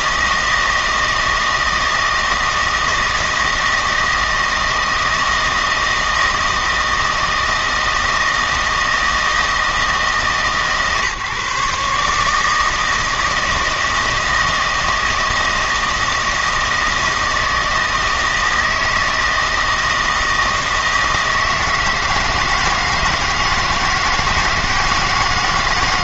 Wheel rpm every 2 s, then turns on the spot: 160, 160, 160, 160, 160, 140, 160, 160, 160, 160, 160, 160, 170.
none